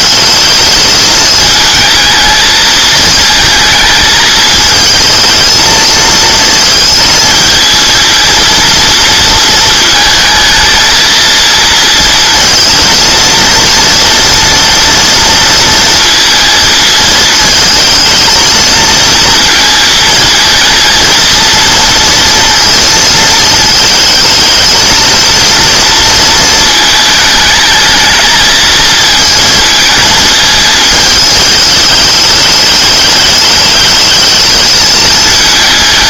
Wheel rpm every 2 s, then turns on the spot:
220, 220, 220, 220, 230, 220, 230, 230, 230, 230, 230, 230, 220, 220, 220, 220, 210, 220.
none